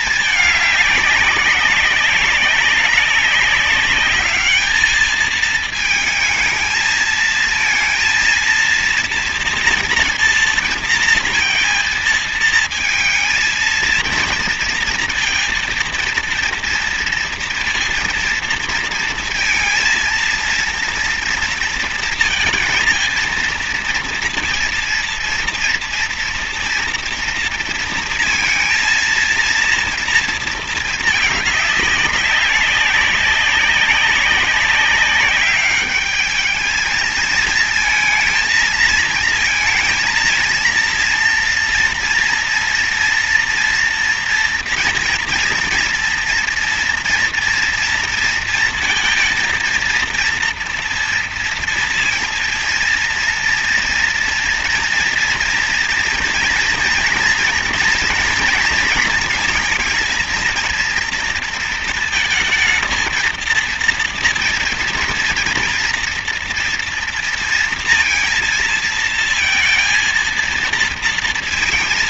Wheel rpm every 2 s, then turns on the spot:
200, 200, 210, 220, 230, 230, 230, 230, 230, 230, 230, 230, 230, 230, 230, 220, 190, 200, 220, 230, 230, 230, 230, 230, 230, 230, 230, 230, 230, 230, 230, 230, 230, 230, 230, 230.
none